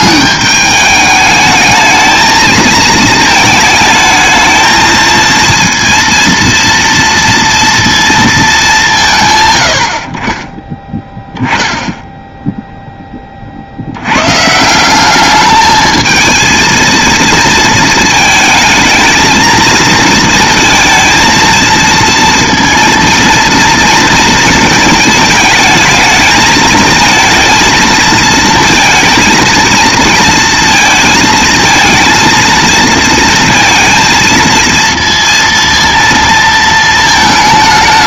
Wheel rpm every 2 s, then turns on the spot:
210, 220, 220, 230, 180, 10, 0, 160, 230, 220, 230, 230, 220, 220, 230, 230, 230, 230, 220.
none